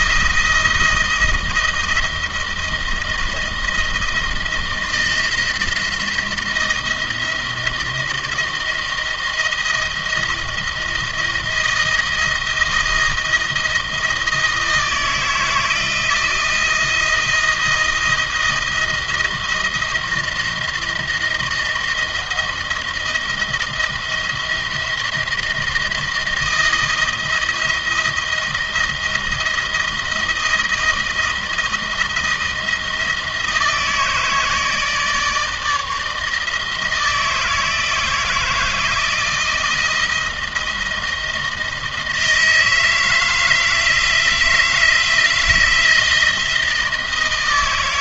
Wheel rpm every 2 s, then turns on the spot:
170, 160, 160, 160, 170, 160, 160, 160, 160, 160, 160, 160, 170, 170, 160, 160, 160, 160, 160, 170, 160, 160, 160, 160.
none